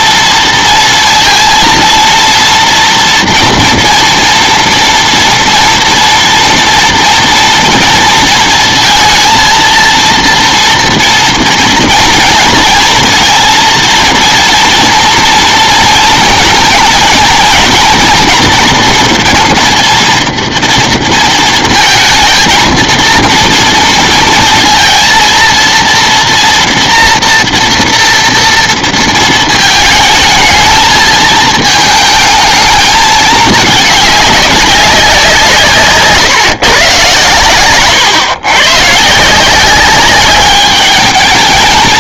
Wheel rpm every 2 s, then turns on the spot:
230, 230, 230, 230, 230, 230, 230, 230, 230, 230, 230, 230, 230, 230, 230, 220, 220, 200, 130, 120, 210.
none